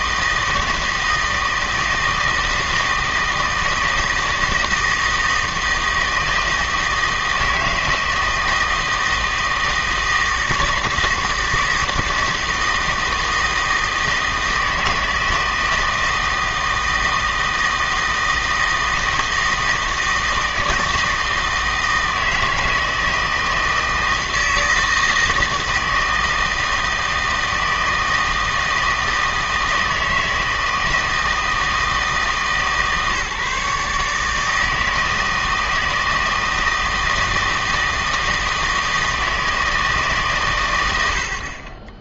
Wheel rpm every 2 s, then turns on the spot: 160, 160, 160, 160, 160, 160, 160, 160, 160, 160, 160, 160, 160, 160, 160, 160, 140, 160, 160, 160, 110.
none